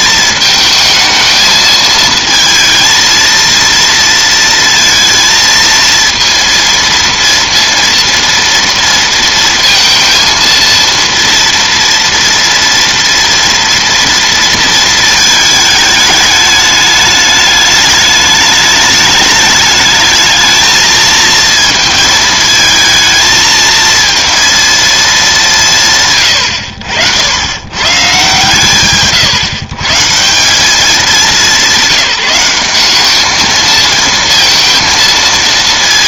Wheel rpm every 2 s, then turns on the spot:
220, 230, 230, 230, 230, 230, 230, 220, 210, 210, 220, 220, 220, 80, 140, 200, 200, 230.
none